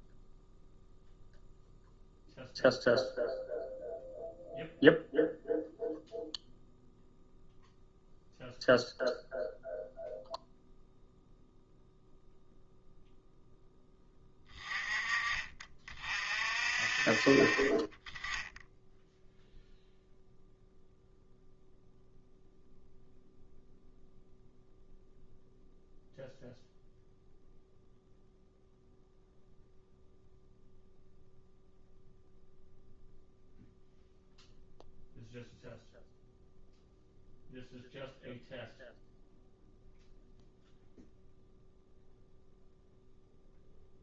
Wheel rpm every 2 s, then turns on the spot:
0, 0, 0, 0, 0, 0, 0, 20, 50, 10, 0, 0, 0, 0, 0, 0, 0, 0, 0, 0, 0, 0.
none